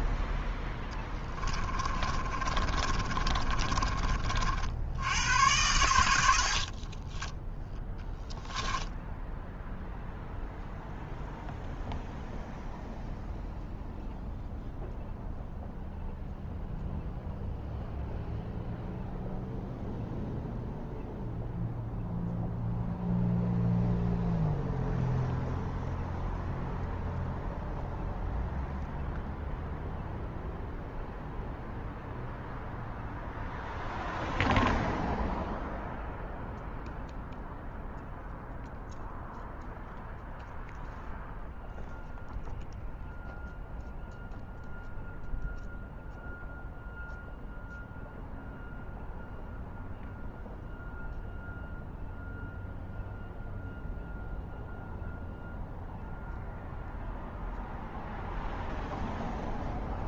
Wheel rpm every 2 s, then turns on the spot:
10, 30, 60, 60, 0, 0, 0, 0, 0, 0, 0, 0, 0, 0, 0, 0, 0, 0, 0, 0, 0, 0, 0, 0, 0, 0, 0, 0, 0, 0.
0-4 6-8